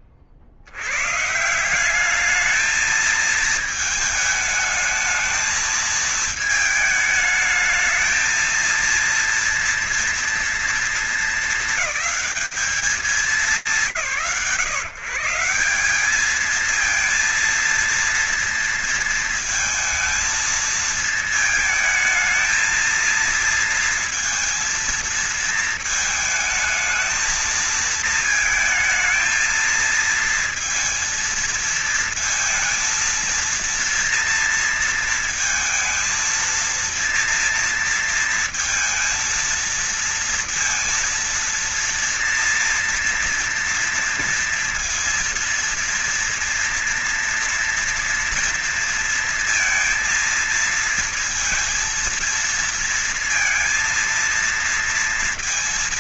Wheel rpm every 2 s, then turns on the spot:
50, 210, 220, 220, 220, 230, 210, 140, 220, 230, 230, 230, 230, 220, 220, 230, 230, 230, 230, 230, 230, 230, 230, 230, 230, 230, 230, 230.
none